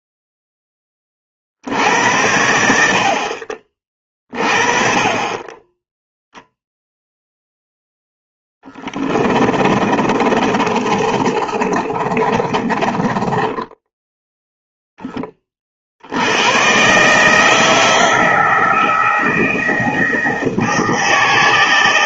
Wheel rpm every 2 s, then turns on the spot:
10, 70, 30, 0, 10, 30, 20, 0, 120, 160, 160.
8-14